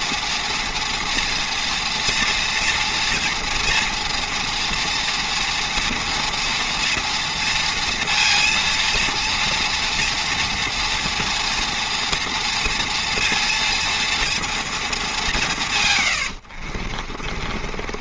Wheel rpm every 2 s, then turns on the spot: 230, 230, 230, 230, 230, 240, 240, 230, 80.
16-18